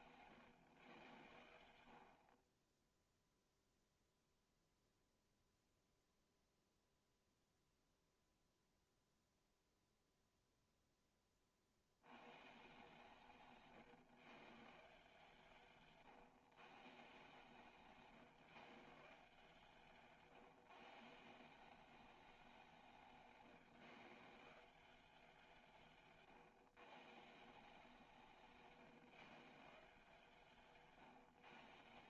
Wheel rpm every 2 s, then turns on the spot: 120, 20, 0, 0, 0, 0, 140, 150, 140, 150, 140, 180, 180, 140, 160, 150.
none